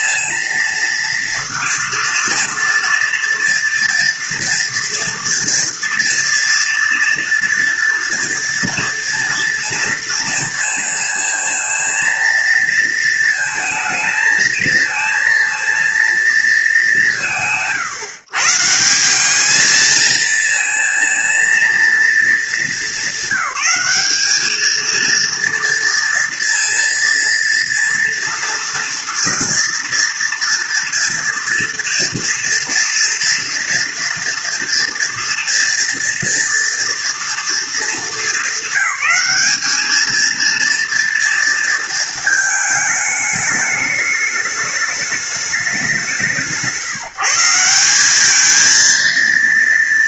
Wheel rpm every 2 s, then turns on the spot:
230, 230, 230, 230, 230, 230, 220, 230, 180, 180, 230, 200, 230, 230, 240, 230, 230, 230, 230, 200, 230, 220, 210, 150, 230.
none